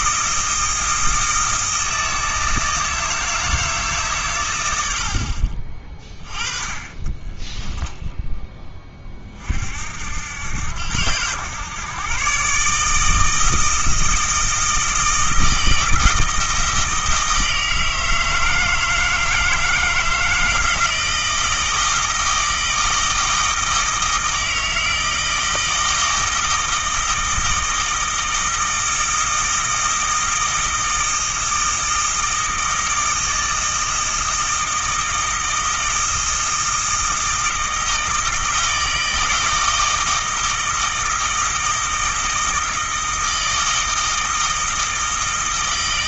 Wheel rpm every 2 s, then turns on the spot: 160, 160, 70, 20, 30, 100, 160, 160, 160, 160, 160, 160, 160, 160, 160, 160, 160, 160, 160, 160, 160, 160, 160.
6-8